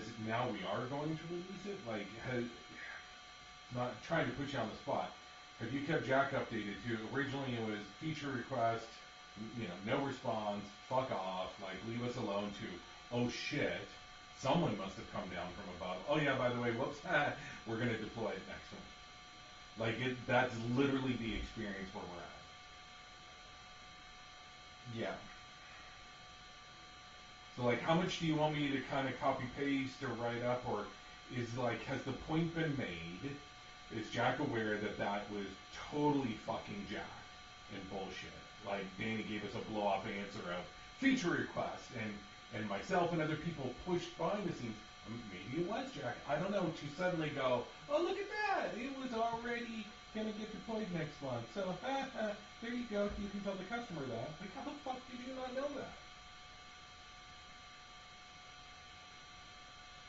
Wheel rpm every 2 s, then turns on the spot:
0, 0, 0, 0, 0, 0, 0, 0, 0, 0, 0, 0, 0, 0, 0, 0, 0, 0, 0, 0, 0, 0, 0, 0, 0, 0, 0, 0, 0, 0.
none